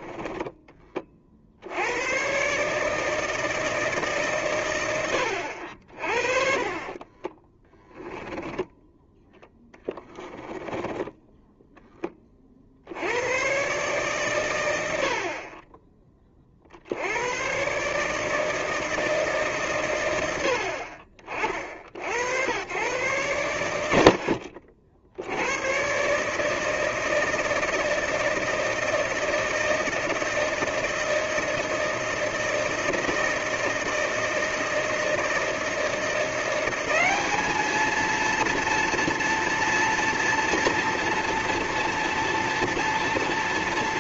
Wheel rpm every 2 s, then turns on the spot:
20, 140, 120, 40, 10, 10, 50, 110, 60, 160, 70, 100, 60, 150, 160, 160, 160, 160, 180, 230, 240, 230.
8-12